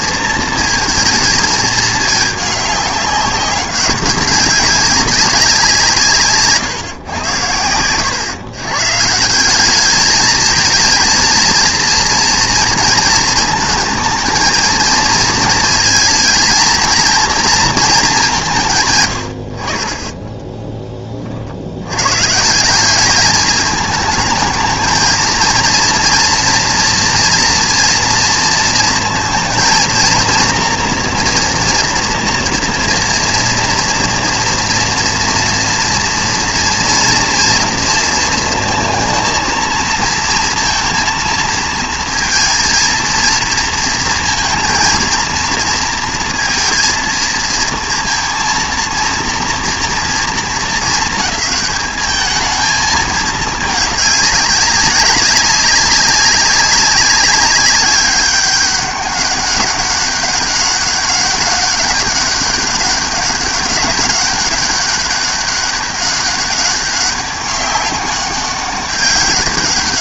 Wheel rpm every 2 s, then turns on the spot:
230, 200, 200, 140, 130, 220, 230, 220, 220, 160, 20, 180, 220, 230, 230, 230, 230, 230, 230, 230, 230, 230, 220, 230, 230, 220, 220, 200, 200, 200, 200, 200, 190, 200, 190.
none